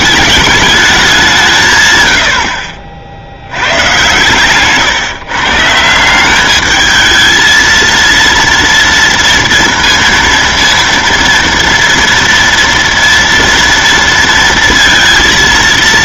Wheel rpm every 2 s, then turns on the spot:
210, 60, 140, 210, 230, 230, 230, 230.
none